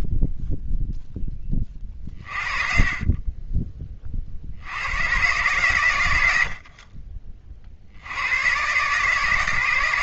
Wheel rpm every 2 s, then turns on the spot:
0, 30, 70, 60, 120.
none